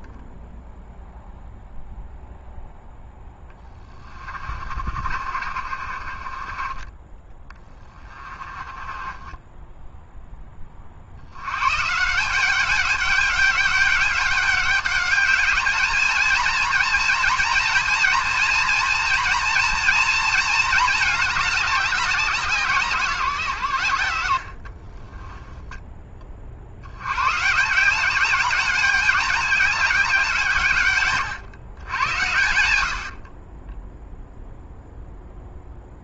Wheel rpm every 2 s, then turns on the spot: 0, 0, 40, 20, 20, 70, 200, 210, 230, 240, 210, 150, 20, 120, 200, 130, 50, 0.
4-10 24-26